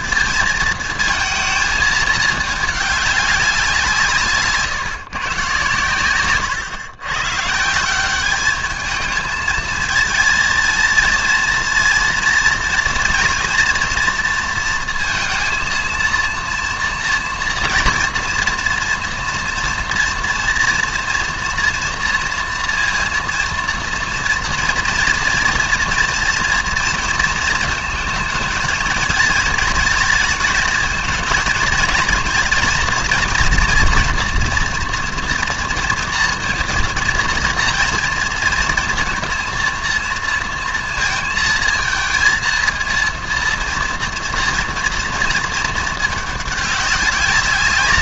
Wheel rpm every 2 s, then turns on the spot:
230, 210, 150, 110, 210, 230, 230, 230, 230, 230, 230, 230, 240, 230, 220, 220, 230, 230, 230, 230, 230, 230, 230, 210.
4-6